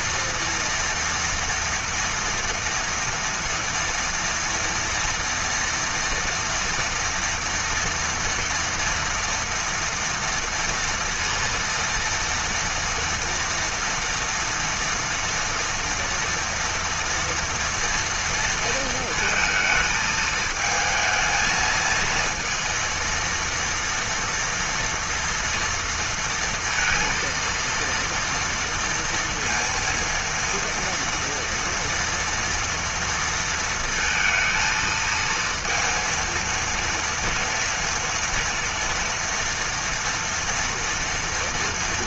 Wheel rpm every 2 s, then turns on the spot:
230, 230, 230, 230, 230, 230, 230, 230, 230, 230, 220, 230, 230, 230, 230, 230, 230, 230, 230, 230, 240.
none